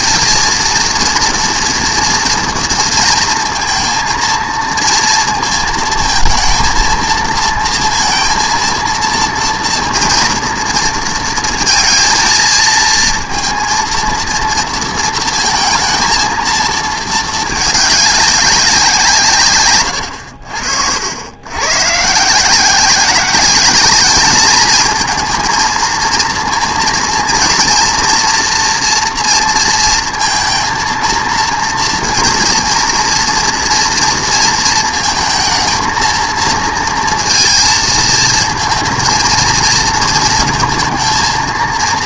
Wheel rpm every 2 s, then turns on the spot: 230, 230, 230, 230, 230, 230, 220, 230, 220, 190, 70, 170, 210, 230, 240, 230, 240, 230, 230, 220, 220.
none